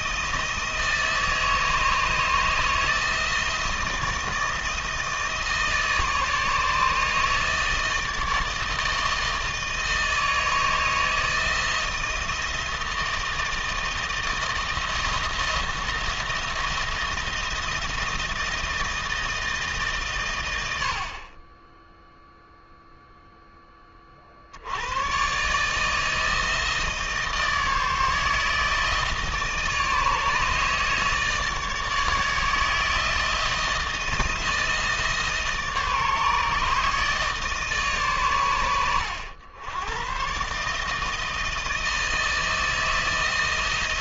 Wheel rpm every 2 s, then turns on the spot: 160, 160, 160, 150, 160, 160, 160, 170, 170, 160, 50, 0, 120, 160, 160, 150, 160, 160, 150, 90, 160, 160.
none